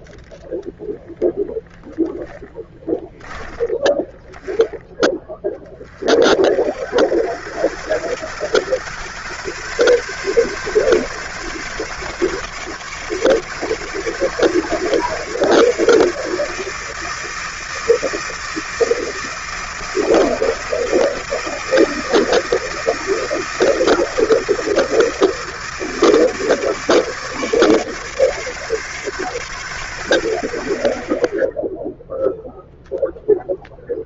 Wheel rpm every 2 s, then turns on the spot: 10, 10, 20, 60, 120, 140, 140, 140, 160, 160, 160, 160, 160, 150, 140, 70, 0.
0-4